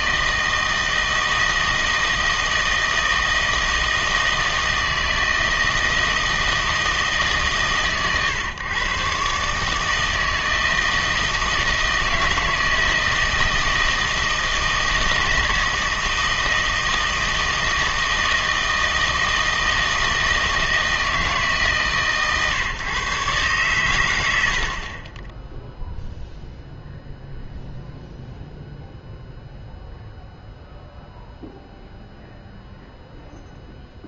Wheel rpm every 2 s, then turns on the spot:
160, 160, 160, 160, 120, 160, 160, 160, 160, 160, 160, 140, 60, 0, 0, 0, 0.
none